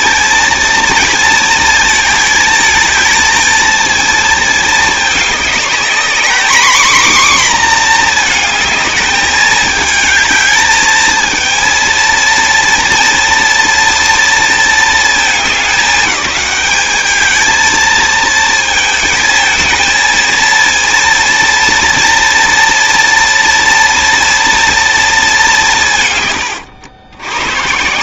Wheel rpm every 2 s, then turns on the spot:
230, 220, 210, 250, 220, 220, 230, 230, 210, 220, 230, 230, 230, 110.
none